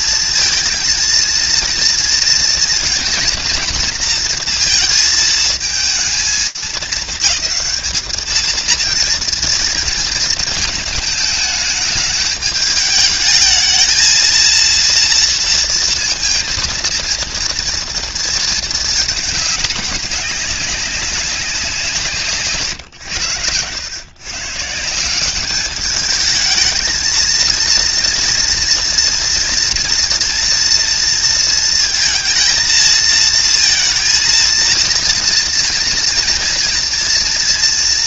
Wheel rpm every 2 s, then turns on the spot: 230, 230, 230, 220, 230, 220, 210, 230, 230, 220, 190, 120, 150, 220, 230, 230, 230, 230, 230.
none